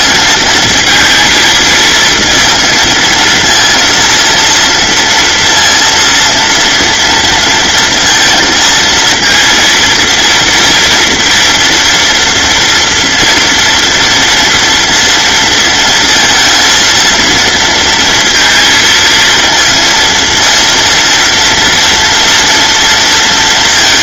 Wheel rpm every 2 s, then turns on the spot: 220, 220, 230, 230, 230, 230, 230, 230, 230, 230, 230, 230.
none